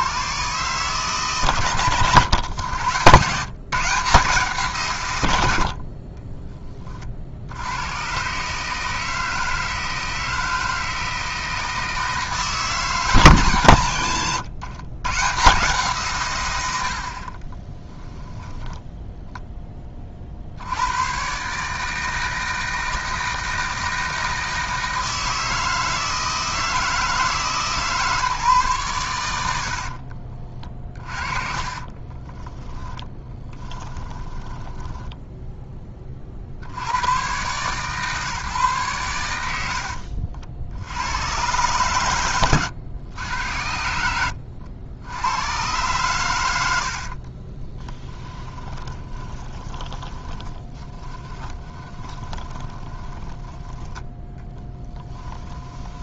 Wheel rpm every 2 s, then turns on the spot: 150, 110, 160, 20, 140, 160, 160, 130, 100, 10, 70, 160, 160, 160, 140, 30, 10, 20, 80, 130, 70, 110, 80, 90, 20, 20, 20, 10.
18-20 30-36 48-56